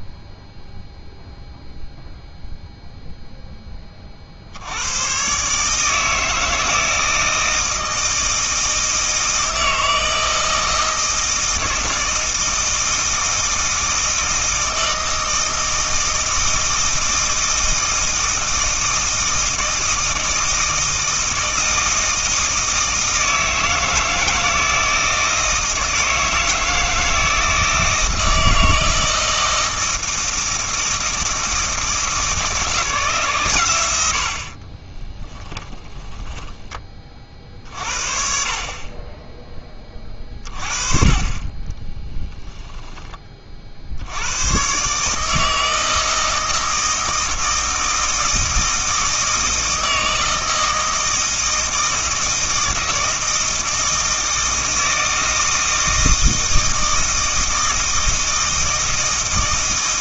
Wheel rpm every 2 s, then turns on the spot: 0, 0, 100, 160, 160, 160, 160, 160, 160, 160, 160, 160, 160, 160, 160, 160, 160, 20, 30, 40, 30, 20, 140, 160, 160, 160, 160, 160, 160, 160.
34-36 42-44